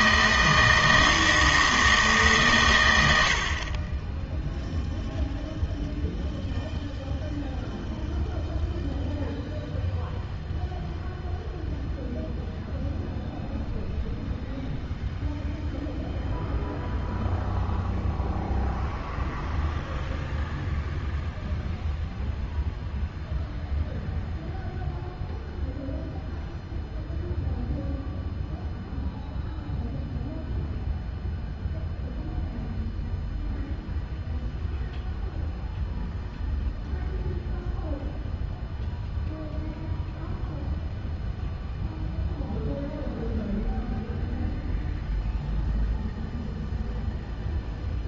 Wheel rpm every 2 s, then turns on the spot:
160, 120, 0, 0, 0, 0, 0, 0, 0, 0, 0, 0, 0, 0, 0, 0, 0, 0, 0, 0, 0, 0, 0, 0.
none